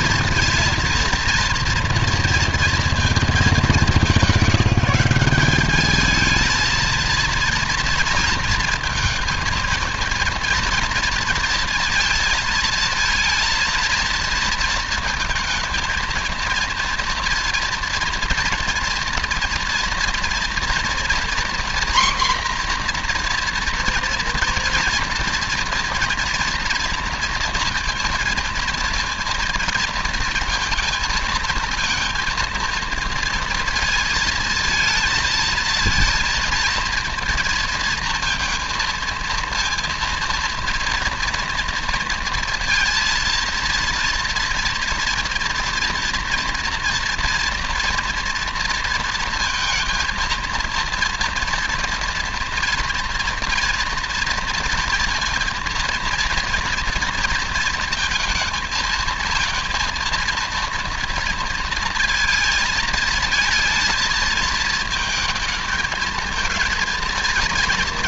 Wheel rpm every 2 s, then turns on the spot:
230, 220, 190, 220, 230, 230, 230, 220, 230, 230, 240, 250, 230, 230, 230, 230, 230, 220, 230, 230, 230, 230, 240, 240, 230, 230, 240, 230, 230, 230, 230, 220, 220, 230.
none